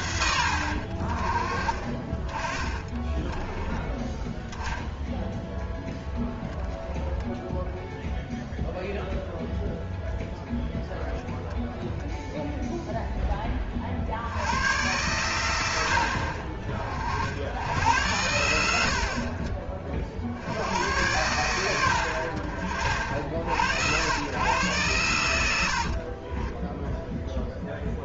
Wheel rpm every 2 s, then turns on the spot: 60, 20, 10, 0, 0, 10, 0, 100, 50, 70, 80, 50, 110, 10.
2-4 26-28